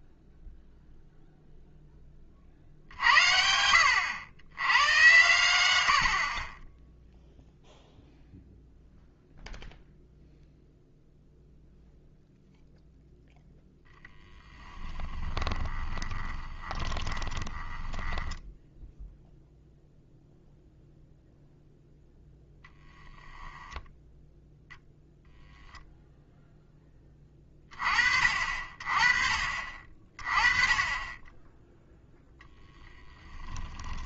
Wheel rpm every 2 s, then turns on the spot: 0, 40, 110, 10, 0, 0, 0, 10, 10, 0, 0, 0, 0, 10, 40, 20, 10.
14-18